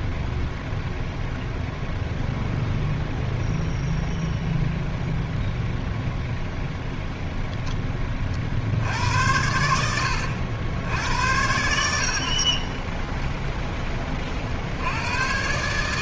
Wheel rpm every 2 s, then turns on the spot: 0, 0, 0, 0, 80, 80, 20, 90.
none